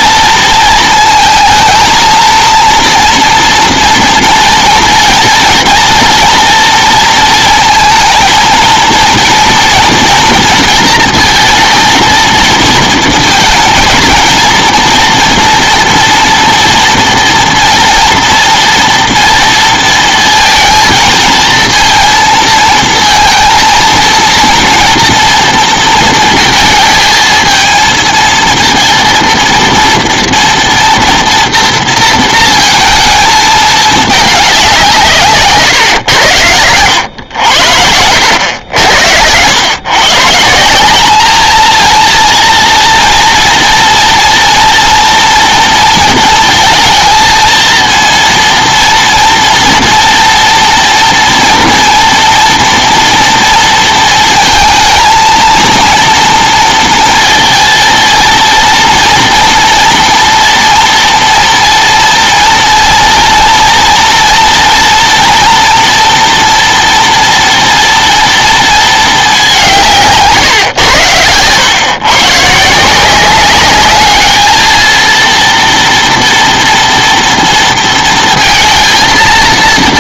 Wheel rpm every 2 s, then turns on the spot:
220, 230, 230, 230, 220, 230, 220, 230, 230, 230, 220, 230, 230, 220, 230, 230, 230, 190, 110, 90, 180, 230, 240, 230, 230, 230, 230, 230, 230, 230, 230, 230, 230, 240, 230, 130, 150, 220, 230, 230.
38-40